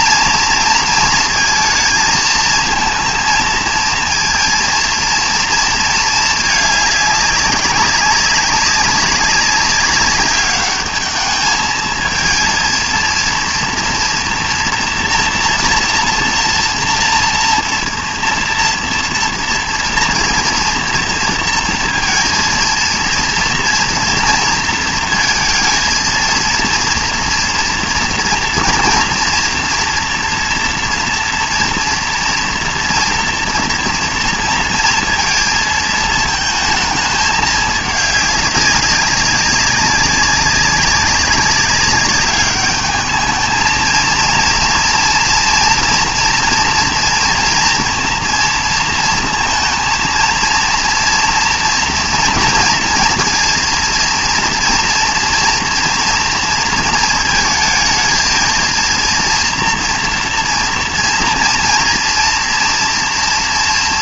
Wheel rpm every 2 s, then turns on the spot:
230, 230, 230, 210, 200, 210, 230, 240, 230, 230, 240, 230, 230, 230, 240, 230, 230, 230, 220, 200, 200, 210, 230, 230, 230, 230, 230, 230, 230, 230, 230, 230.
none